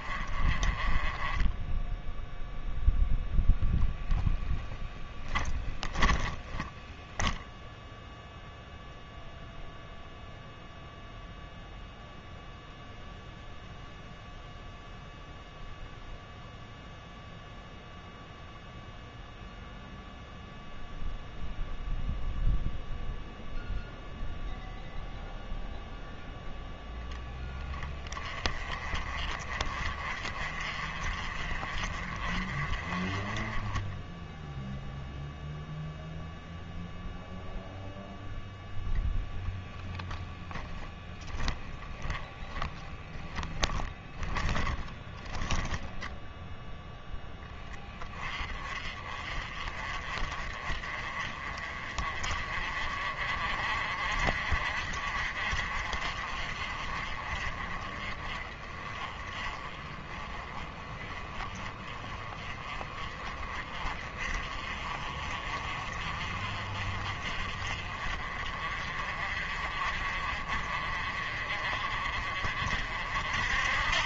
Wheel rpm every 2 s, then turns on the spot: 20, 0, 10, 10, 0, 0, 0, 0, 0, 0, 0, 0, 0, 0, 30, 40, 30, 0, 0, 0, 0, 0, 10, 10, 30, 40, 40, 50, 40, 30, 30, 30, 40, 40, 40, 40, 50.
6-8 44-46